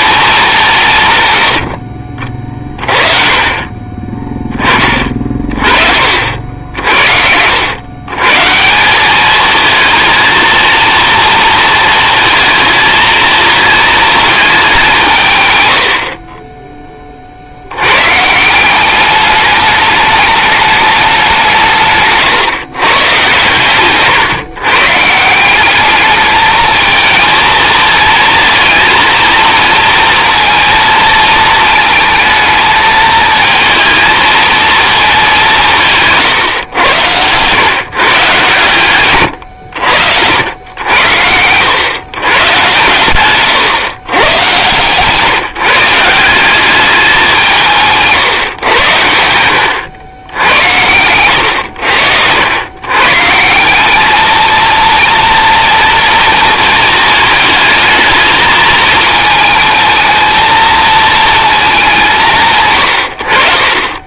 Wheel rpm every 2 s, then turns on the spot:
170, 40, 20, 70, 160, 230, 230, 200, 10, 180, 210, 140, 150, 220, 230, 230, 220, 220, 110, 120, 90, 130, 130, 200, 110, 90, 110, 220, 220, 220, 220, 100.
48-50